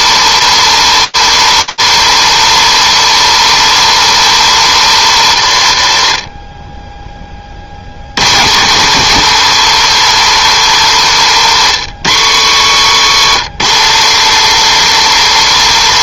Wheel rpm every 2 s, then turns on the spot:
150, 150, 140, 30, 150, 130, 130, 150.
none